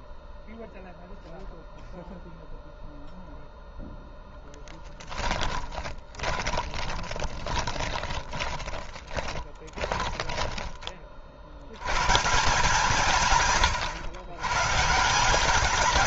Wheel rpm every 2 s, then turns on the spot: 0, 0, 10, 20, 20, 20, 170, 140.
4-10